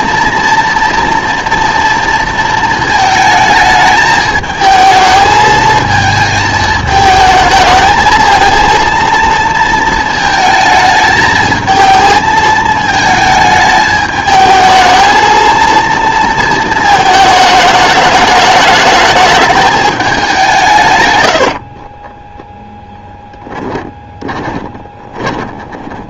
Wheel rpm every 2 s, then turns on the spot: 230, 220, 220, 220, 230, 220, 220, 220, 220, 210, 150, 0, 20.
24-26